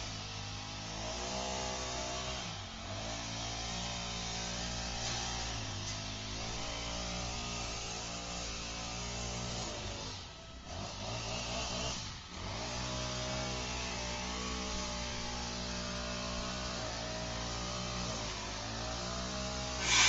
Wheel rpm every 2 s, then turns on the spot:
0, 0, 0, 0, 0, 0, 0, 0, 0, 0.
none